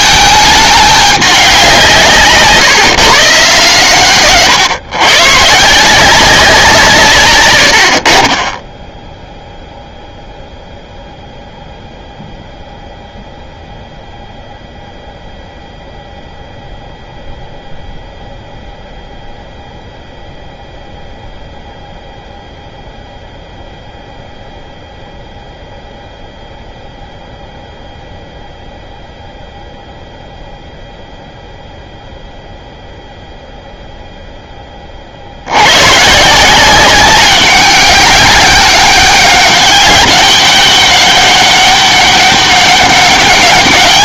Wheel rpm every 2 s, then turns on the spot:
210, 140, 130, 170, 30, 0, 0, 0, 0, 0, 0, 0, 0, 0, 0, 0, 0, 10, 170, 200, 200, 200.
none